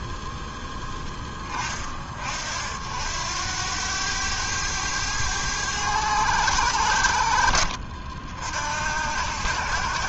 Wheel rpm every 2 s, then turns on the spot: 0, 50, 100, 90, 70.
none